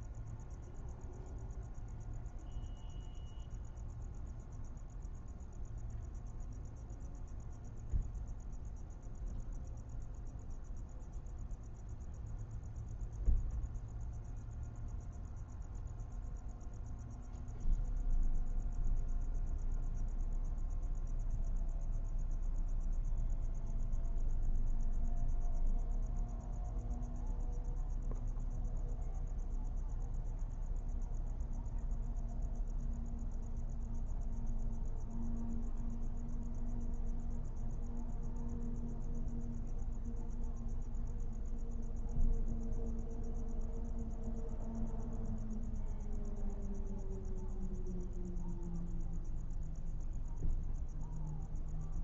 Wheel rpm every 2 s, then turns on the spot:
0, 0, 0, 0, 0, 0, 0, 0, 0, 0, 0, 0, 0, 0, 0, 0, 0, 0, 0, 0, 0, 0, 0, 0, 0, 0.
none